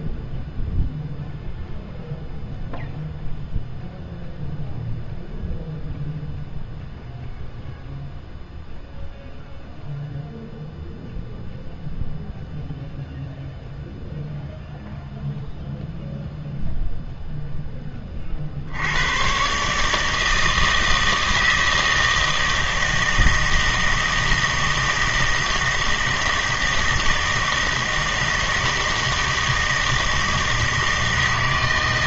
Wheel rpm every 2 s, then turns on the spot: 0, 0, 0, 0, 0, 0, 0, 0, 0, 70, 160, 160, 160, 160, 160, 160.
none